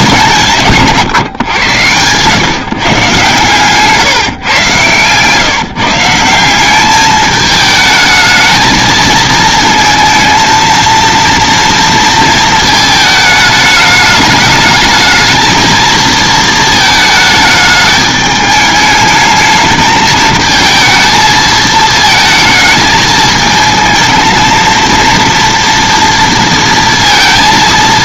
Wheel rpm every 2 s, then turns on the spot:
160, 140, 130, 180, 220, 230, 220, 210, 220, 210, 220, 220, 230, 230.
none